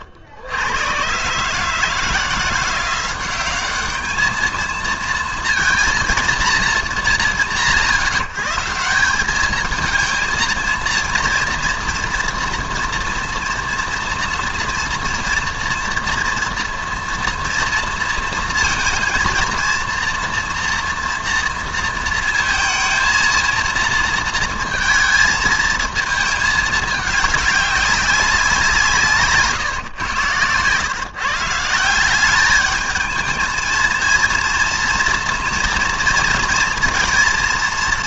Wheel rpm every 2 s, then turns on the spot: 110, 170, 220, 230, 180, 230, 240, 230, 230, 230, 240, 220, 230, 210, 170, 120, 210, 240, 230.
none